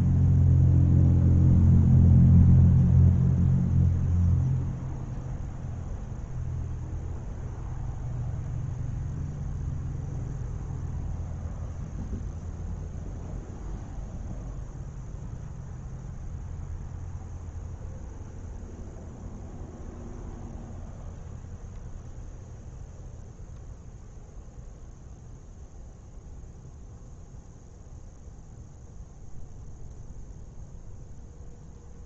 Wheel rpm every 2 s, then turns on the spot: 0, 0, 0, 0, 0, 0, 0, 0, 0, 0, 0, 0, 0, 0, 0, 0.
none